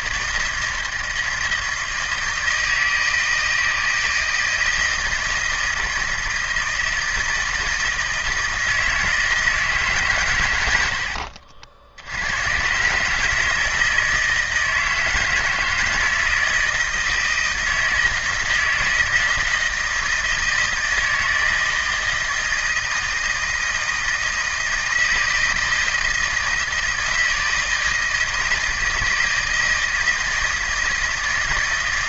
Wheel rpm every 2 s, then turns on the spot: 160, 160, 160, 160, 160, 90, 130, 160, 160, 160, 160, 160, 160, 160, 160, 160.
none